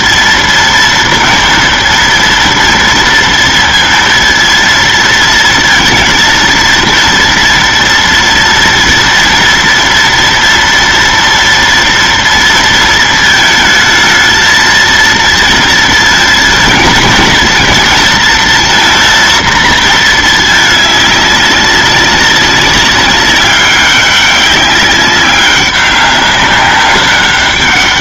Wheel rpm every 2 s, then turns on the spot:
230, 230, 230, 230, 230, 230, 230, 220, 220, 230, 210, 200, 200, 200.
none